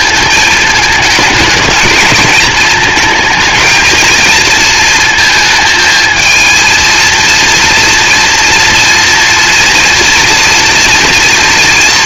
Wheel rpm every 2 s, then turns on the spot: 220, 220, 230, 230, 240, 230.
none